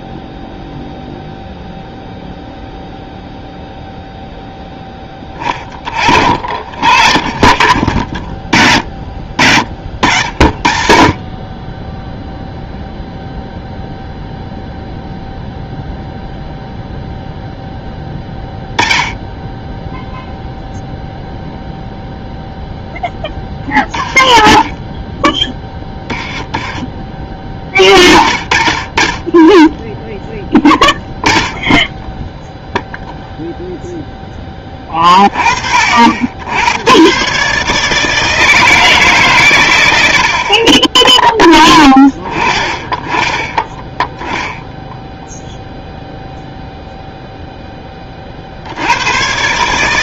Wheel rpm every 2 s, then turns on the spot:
0, 0, 10, 60, 40, 60, 0, 0, 0, 10, 0, 0, 20, 20, 30, 10, 0, 20, 90, 160, 20, 10, 0, 0, 80.
6-8 24-28